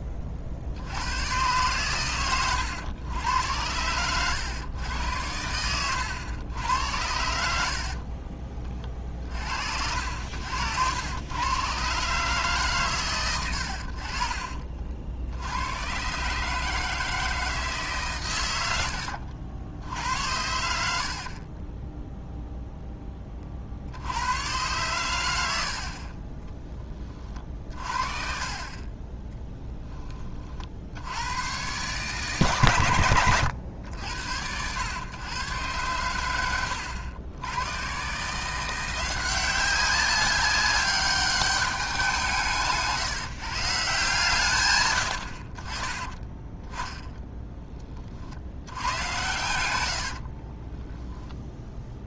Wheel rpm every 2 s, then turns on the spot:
70, 110, 100, 90, 40, 90, 130, 50, 160, 80, 70, 0, 110, 20, 20, 60, 130, 100, 90, 170, 200, 160, 120, 10, 100, 20.
20-22 46-48 50-52